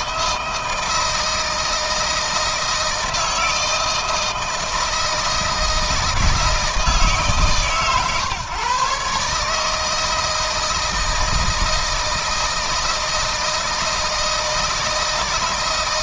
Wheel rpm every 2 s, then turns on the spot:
160, 160, 160, 160, 140, 160, 160, 160.
none